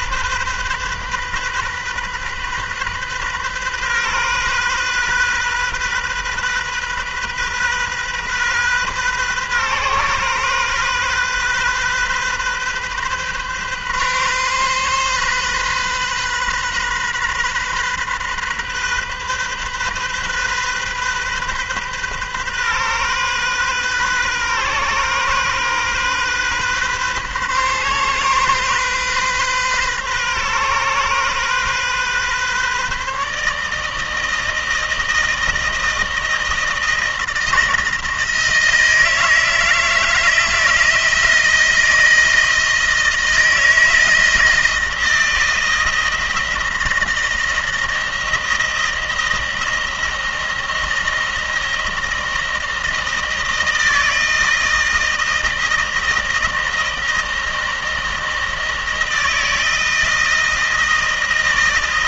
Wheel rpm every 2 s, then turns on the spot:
130, 130, 130, 130, 130, 130, 130, 130, 130, 130, 130, 130, 130, 130, 130, 130, 140, 160, 160, 160, 160, 160, 160, 160, 160, 170, 160, 160, 160, 160, 170.
none